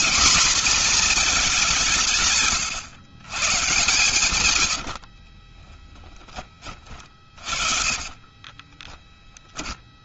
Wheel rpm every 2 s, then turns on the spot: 240, 120, 60, 30, 30.
4-8